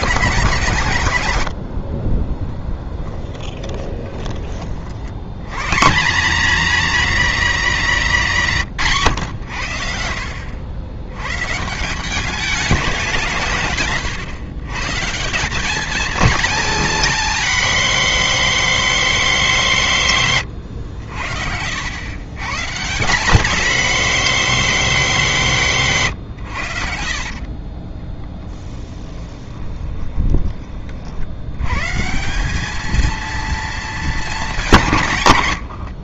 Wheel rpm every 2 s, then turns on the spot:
150, 20, 40, 220, 140, 100, 200, 140, 230, 230, 110, 150, 230, 90, 10, 30, 210, 180.
2-4 28-30